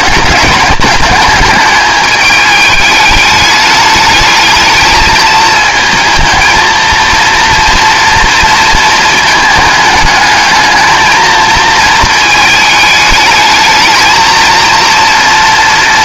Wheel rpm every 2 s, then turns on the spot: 210, 210, 220, 220, 220, 220, 220, 230.
none